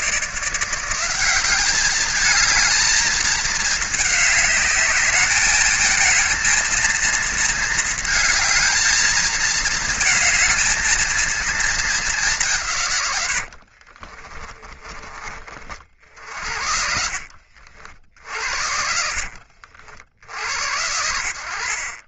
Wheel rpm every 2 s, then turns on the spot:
160, 210, 210, 220, 220, 220, 190, 20, 50, 60, 70.
14-16 18-20